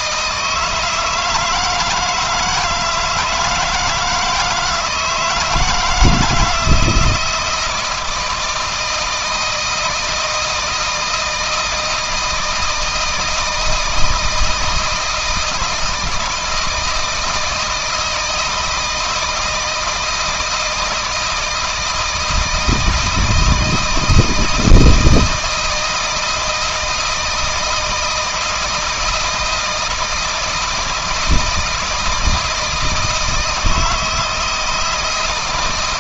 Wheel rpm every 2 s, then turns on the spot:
160, 160, 160, 170, 160, 160, 160, 160, 160, 160, 160, 160, 160, 160, 160, 160, 160, 160.
none